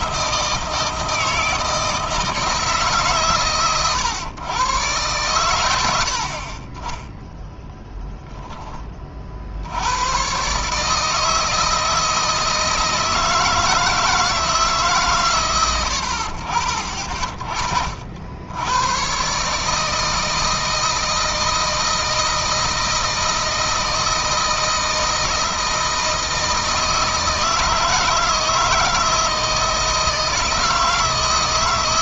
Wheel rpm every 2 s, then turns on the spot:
160, 160, 120, 40, 10, 130, 160, 150, 40, 90, 160, 160, 160, 160, 160, 160.
none